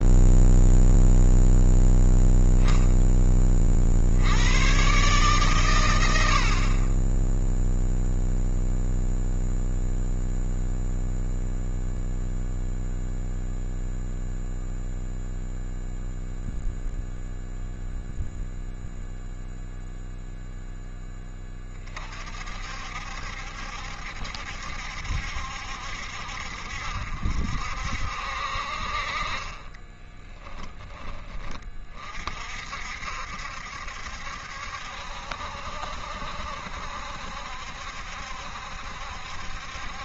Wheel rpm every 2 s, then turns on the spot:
0, 10, 130, 30, 0, 0, 0, 0, 0, 0, 0, 50, 70, 60, 50, 10, 60, 70, 70, 70.
none